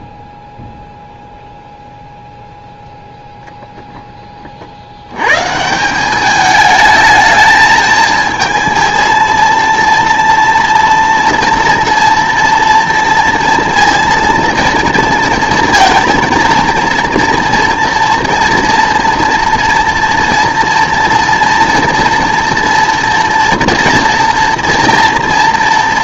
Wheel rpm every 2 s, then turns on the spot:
0, 0, 40, 210, 220, 230, 230, 230, 220, 230, 230, 230, 230.
none